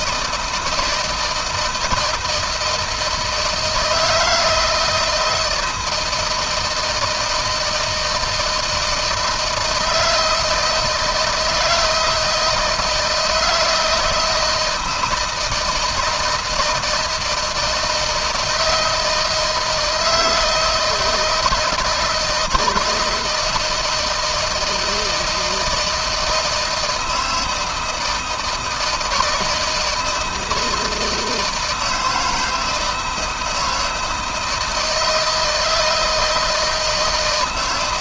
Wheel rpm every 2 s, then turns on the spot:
160, 160, 160, 160, 160, 160, 160, 160, 160, 160, 160, 160, 170, 160, 160, 160, 160, 160, 160.
none